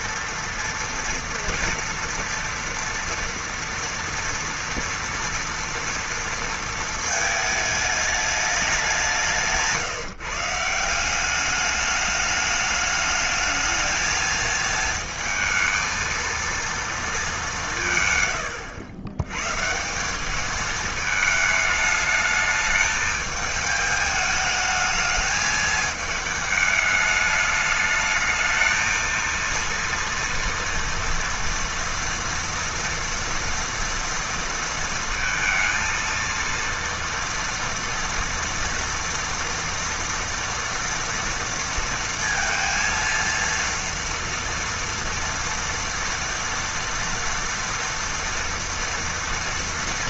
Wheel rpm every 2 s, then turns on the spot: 230, 230, 230, 230, 200, 160, 210, 220, 230, 110, 220, 210, 210, 210, 220, 230, 230, 230, 230, 230, 230, 230, 230, 230, 230.
none